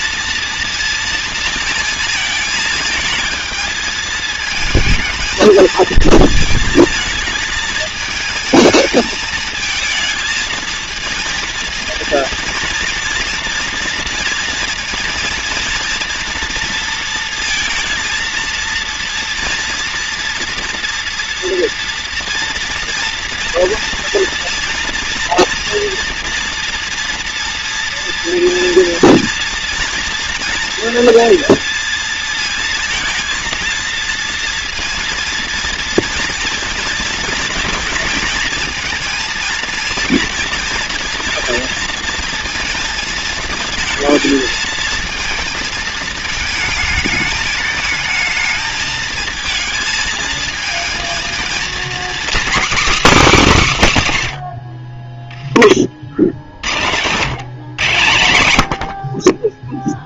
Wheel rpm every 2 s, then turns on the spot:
230, 220, 220, 220, 220, 220, 230, 230, 230, 230, 230, 230, 230, 230, 240, 230, 230, 230, 230, 230, 230, 220, 220, 220, 220, 230, 280, 20, 110, 80.
56-58